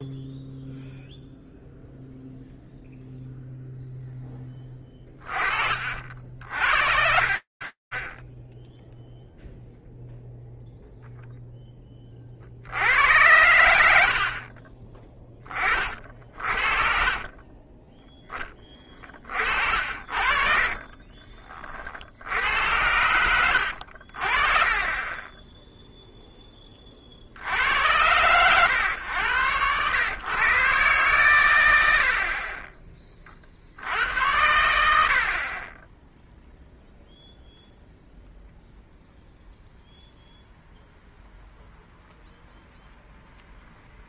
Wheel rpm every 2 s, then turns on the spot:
0, 0, 10, 50, 0, 0, 70, 30, 50, 30, 40, 90, 20, 20, 110, 130, 20, 70, 0, 0, 0, 0.
16-18 20-22